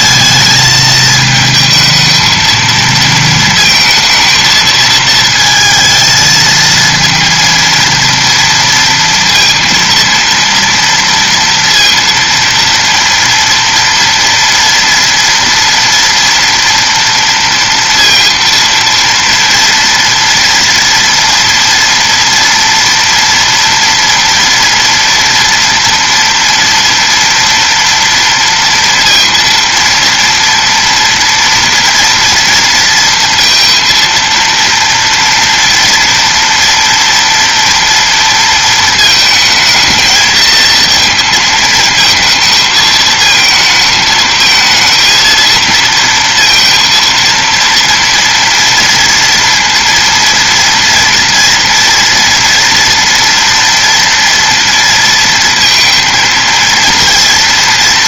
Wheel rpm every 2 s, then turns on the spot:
220, 230, 230, 230, 230, 230, 230, 230, 230, 230, 230, 230, 230, 230, 230, 240, 230, 230, 230, 220, 220, 220, 230, 230, 230, 230, 230, 230, 230.
none